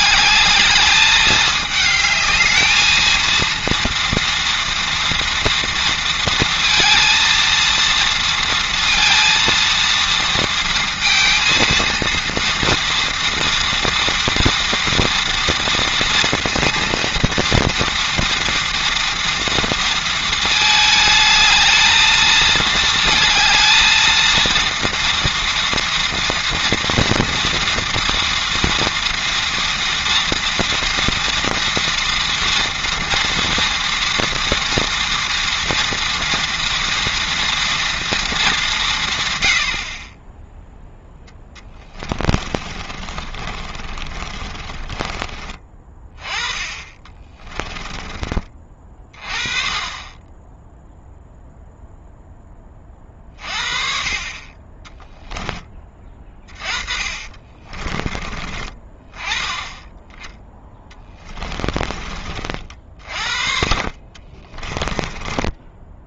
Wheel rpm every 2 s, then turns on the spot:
220, 220, 230, 230, 230, 230, 230, 230, 230, 230, 220, 220, 230, 230, 240, 240, 230, 230, 230, 180, 0, 30, 20, 20, 30, 0, 30, 20, 30, 30, 20, 40, 20.
42-48 56-58 60-66